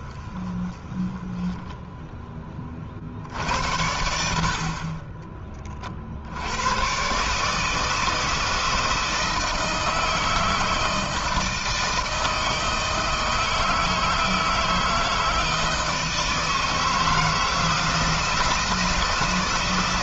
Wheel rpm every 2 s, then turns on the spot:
20, 50, 40, 120, 160, 160, 160, 160, 160, 160.
none